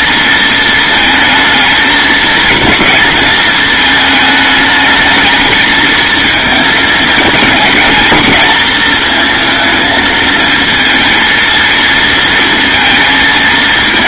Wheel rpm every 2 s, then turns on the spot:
220, 220, 210, 220, 230, 220, 220.
none